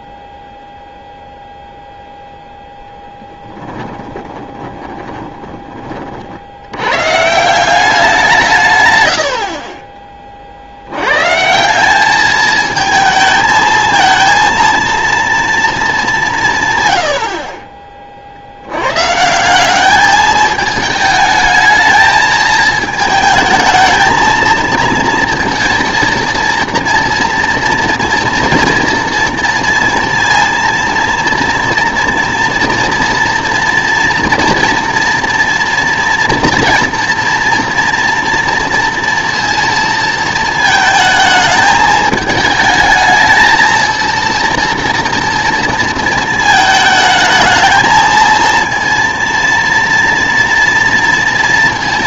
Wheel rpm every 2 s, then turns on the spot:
0, 0, 20, 80, 140, 70, 220, 230, 140, 90, 220, 220, 230, 230, 240, 230, 230, 230, 230, 230, 220, 220, 230, 220, 230, 230.
4-6